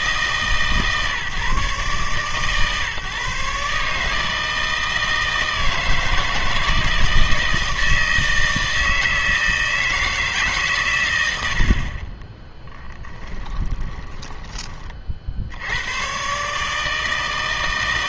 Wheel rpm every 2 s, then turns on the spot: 150, 140, 160, 160, 160, 140, 10, 20, 140.
12-14